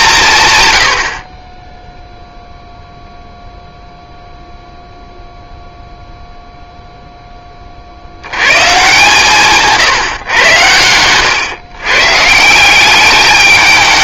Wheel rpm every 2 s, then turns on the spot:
110, 0, 0, 0, 120, 110, 170.
none